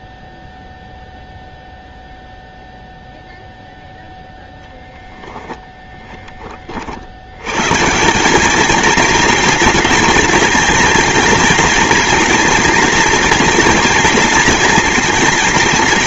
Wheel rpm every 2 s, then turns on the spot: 0, 0, 10, 70, 230, 240, 240, 230.
4-6